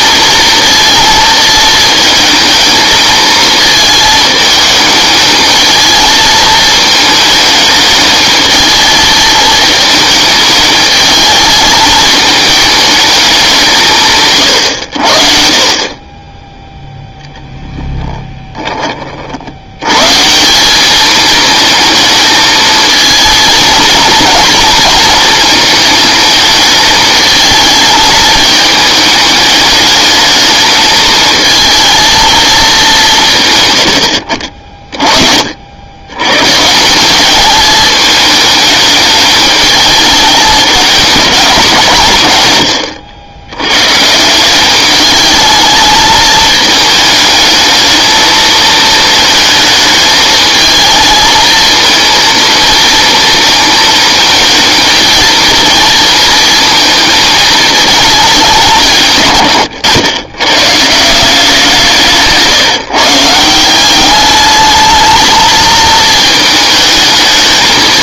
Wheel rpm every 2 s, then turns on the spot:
230, 220, 220, 220, 220, 210, 220, 110, 10, 20, 180, 220, 230, 210, 210, 210, 220, 50, 140, 220, 210, 120, 190, 220, 230, 220, 230, 220, 220, 190, 120, 160, 210, 220.
none